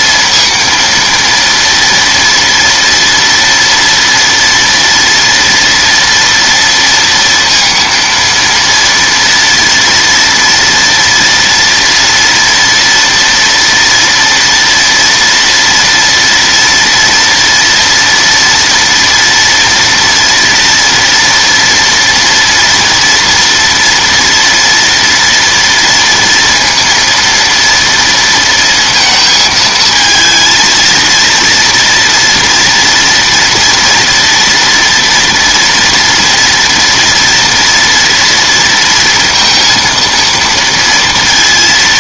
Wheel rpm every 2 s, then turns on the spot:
230, 230, 230, 230, 230, 230, 230, 230, 230, 230, 230, 230, 240, 230, 230, 230, 240, 240, 230, 230, 230.
none